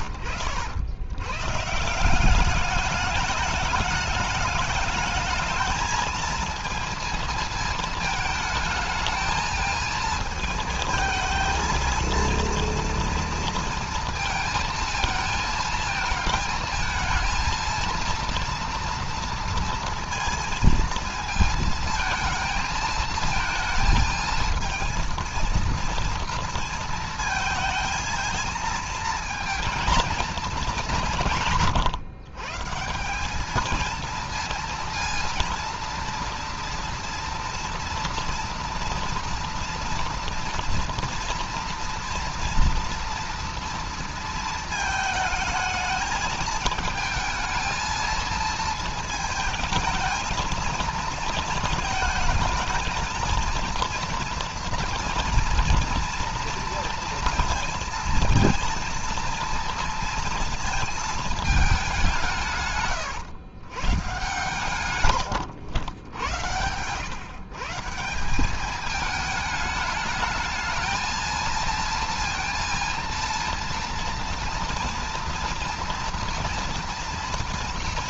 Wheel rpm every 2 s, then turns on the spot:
90, 190, 210, 220, 220, 220, 230, 220, 220, 230, 230, 220, 230, 230, 220, 230, 140, 230, 230, 240, 230, 230, 220, 220, 230, 220, 220, 230, 230, 230, 230, 160, 130, 90, 190, 220, 230, 230, 230.
none